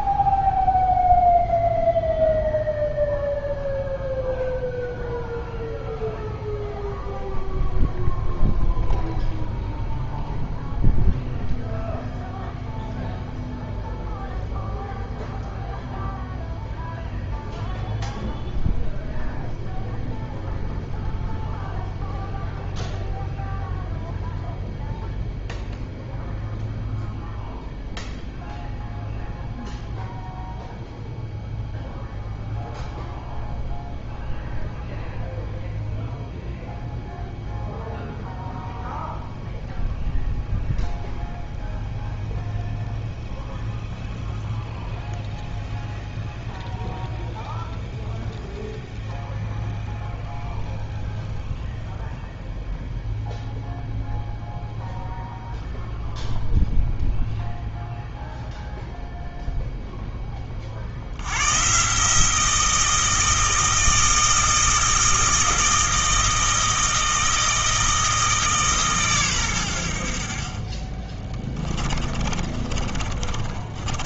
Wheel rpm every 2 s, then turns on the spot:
0, 0, 0, 0, 0, 0, 0, 0, 0, 0, 0, 0, 0, 0, 0, 0, 0, 0, 0, 0, 0, 0, 0, 0, 0, 0, 0, 0, 0, 0, 40, 170, 160, 160, 150, 40, 30.
72-74